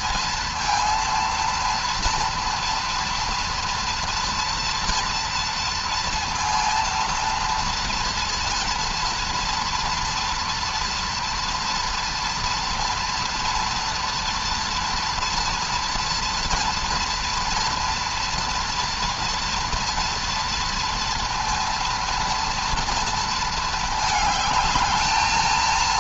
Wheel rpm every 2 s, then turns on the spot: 230, 240, 230, 230, 230, 230, 230, 230, 230, 230, 230, 230, 220.
none